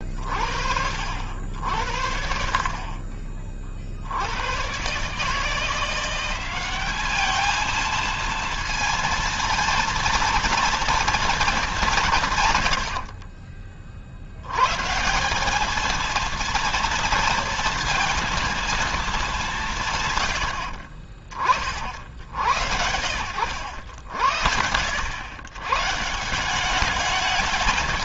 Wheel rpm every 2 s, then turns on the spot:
60, 50, 130, 200, 230, 230, 80, 150, 230, 220, 70, 70, 100, 200.
12-14